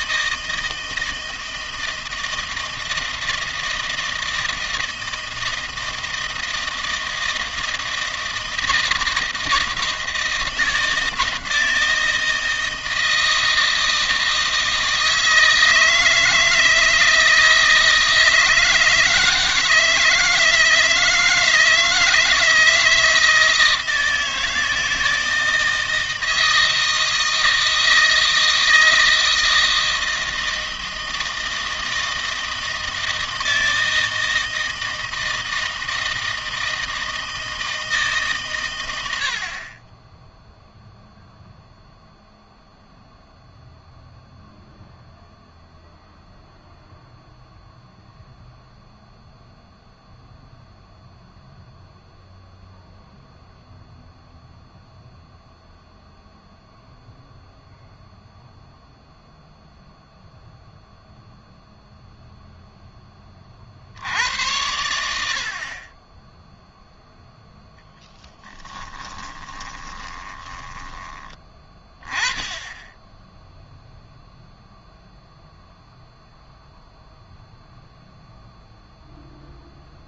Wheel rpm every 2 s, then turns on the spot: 160, 160, 160, 160, 160, 160, 160, 160, 160, 160, 160, 160, 160, 160, 160, 160, 160, 160, 160, 120, 0, 0, 0, 0, 0, 0, 0, 0, 0, 0, 0, 0, 80, 0, 10, 10, 10, 0, 0, 0.
68-72